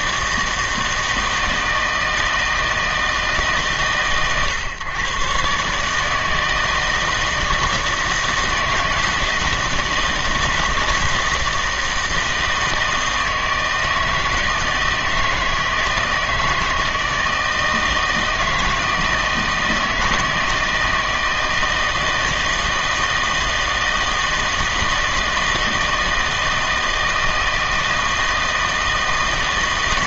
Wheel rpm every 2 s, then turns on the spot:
160, 160, 120, 160, 160, 160, 160, 160, 160, 160, 160, 160, 160, 160, 160.
none